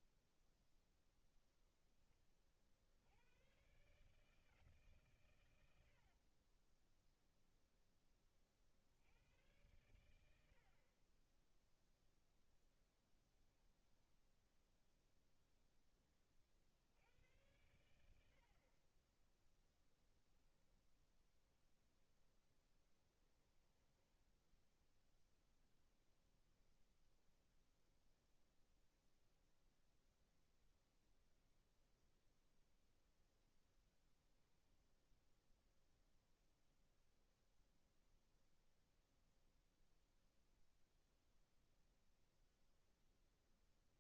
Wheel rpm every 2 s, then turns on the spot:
0, 80, 130, 10, 80, 30, 0, 0, 80, 20, 10, 10, 10, 0, 0, 0, 0, 0, 0, 0, 0, 0.
6-8 22-24